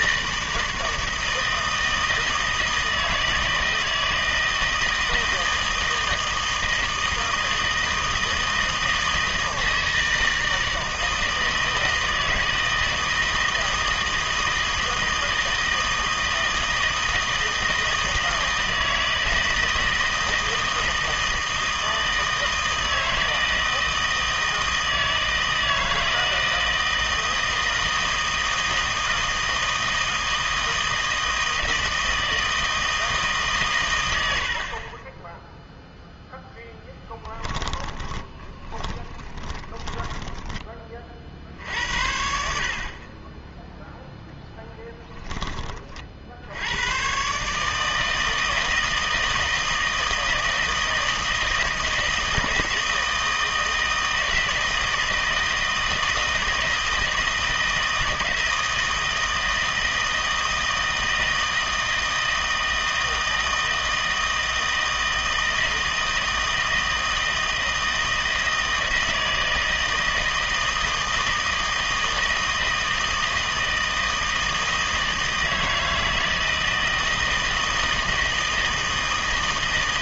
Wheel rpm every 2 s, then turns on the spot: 160, 160, 160, 160, 160, 160, 160, 160, 160, 160, 160, 160, 160, 160, 160, 160, 160, 50, 0, 10, 20, 70, 10, 80, 160, 160, 160, 160, 160, 160, 160, 160, 160, 160, 160, 160, 160, 160, 160, 160.
38-40 44-46